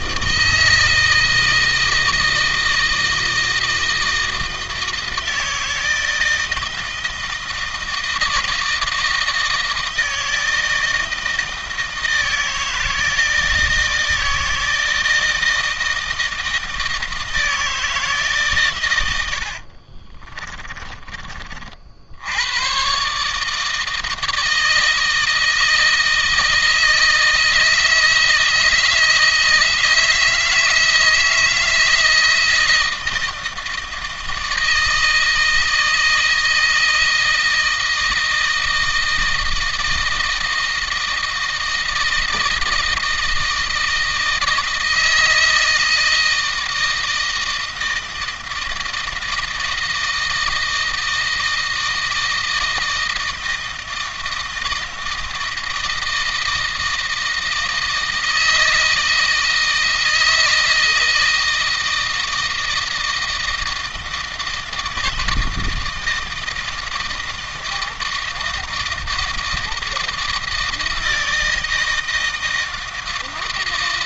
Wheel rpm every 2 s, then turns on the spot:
160, 160, 160, 160, 160, 160, 160, 160, 160, 120, 20, 120, 160, 160, 160, 160, 160, 160, 160, 160, 160, 160, 160, 160, 160, 160, 160, 160, 160, 160, 160, 160, 160, 160, 160, 160, 160.
20-22